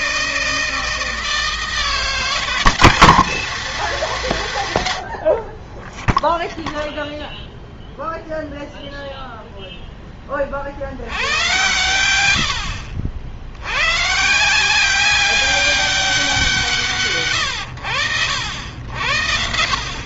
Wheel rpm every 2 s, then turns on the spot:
160, 190, 160, 0, 0, 40, 100, 160, 170, 80.
none